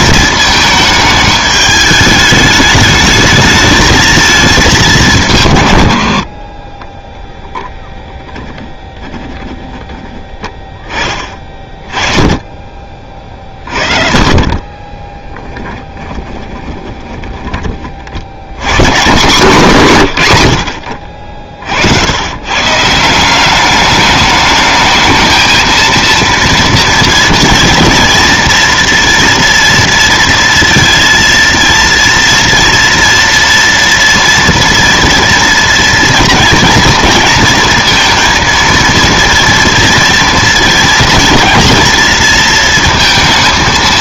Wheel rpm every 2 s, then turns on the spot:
220, 210, 200, 20, 10, 10, 30, 30, 20, 110, 90, 140, 210, 230, 230, 230, 240, 230, 230, 230, 240, 230.
14-18